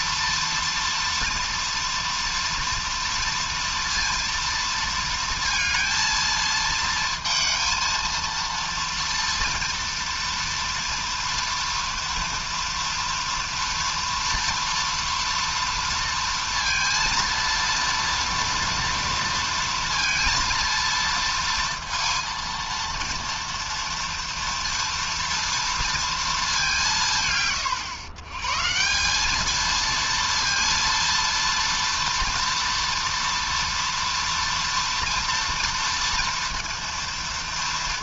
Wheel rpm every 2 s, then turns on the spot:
230, 230, 230, 230, 230, 230, 230, 230, 230, 230, 230, 230, 230, 210, 140, 230, 230, 230, 230.
none